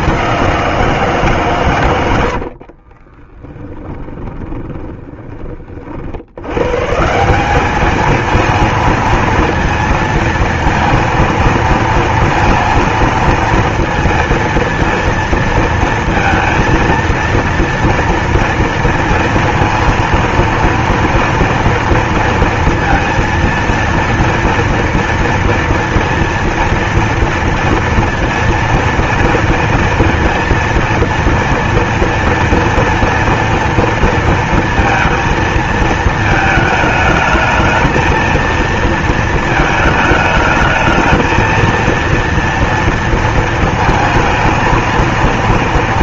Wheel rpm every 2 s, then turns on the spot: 190, 70, 20, 110, 230, 230, 230, 230, 230, 230, 230, 230, 230, 230, 230, 230, 230, 230, 220, 230, 210, 230, 220.
2-6